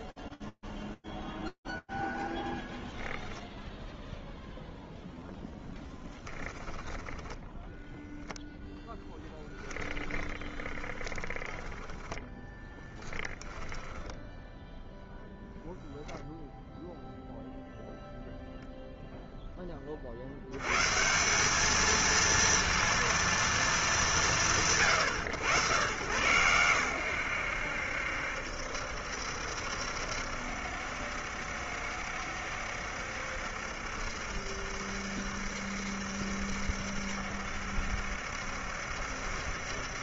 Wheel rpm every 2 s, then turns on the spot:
0, 0, 10, 0, 10, 10, 20, 0, 0, 30, 220, 220, 110, 80, 70, 70, 70, 70, 70, 70.
8-14